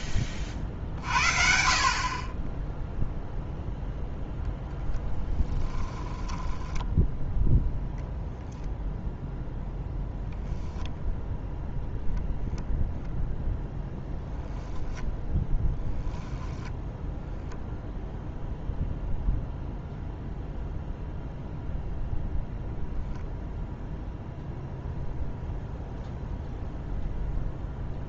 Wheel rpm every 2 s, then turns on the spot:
50, 0, 10, 10, 0, 0, 0, 0, 0, 0, 0, 0, 0, 0.
6-8